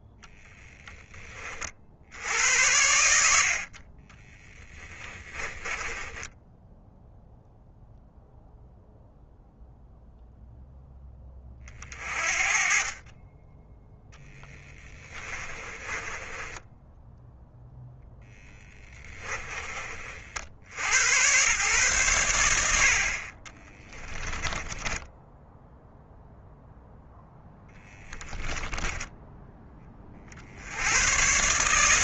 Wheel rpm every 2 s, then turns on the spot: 10, 80, 20, 10, 0, 0, 40, 20, 10, 10, 90, 70, 10, 0, 10, 90.
4-6 14-20 24-26 28-30